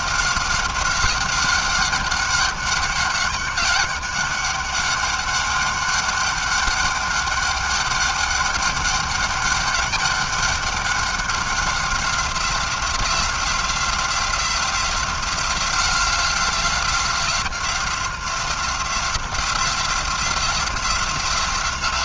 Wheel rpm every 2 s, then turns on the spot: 190, 200, 200, 200, 200, 200, 190, 180, 180, 180, 180.
none